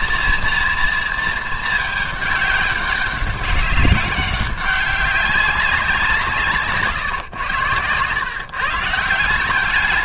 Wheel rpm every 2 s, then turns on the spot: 230, 190, 200, 140, 160.
none